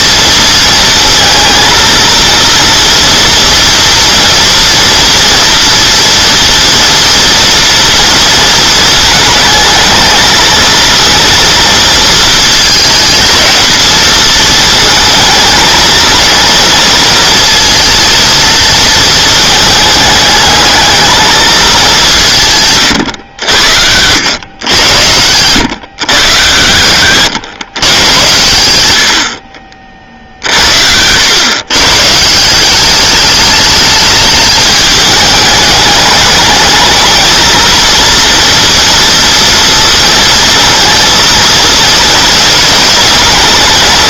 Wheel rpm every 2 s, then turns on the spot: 220, 230, 230, 240, 220, 230, 220, 220, 230, 220, 220, 130, 100, 110, 100, 80, 190, 210, 220, 230, 230, 220.
26-28